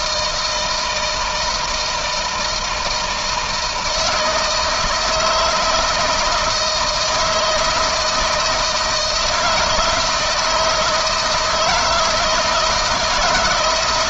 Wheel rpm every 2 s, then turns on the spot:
160, 160, 160, 160, 170, 160, 160.
none